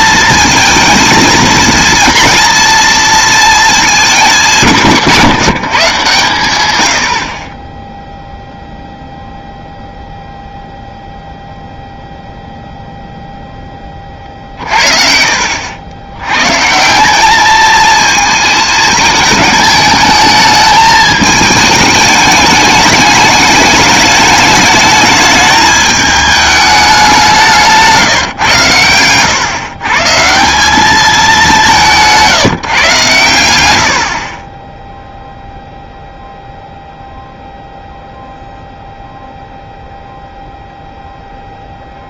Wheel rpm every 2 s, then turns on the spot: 230, 230, 170, 110, 0, 0, 0, 50, 140, 220, 210, 210, 210, 210, 120, 190, 160, 10, 0, 0, 0.
none